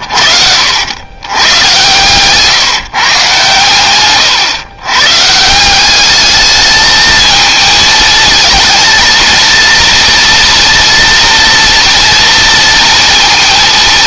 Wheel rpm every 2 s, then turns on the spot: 90, 150, 130, 220, 230, 230, 230.
none